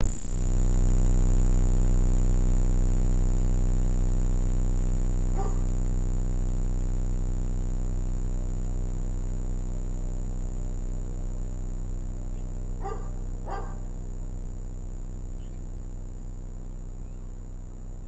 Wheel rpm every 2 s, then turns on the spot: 0, 0, 0, 0, 0, 0, 0, 0, 0.
none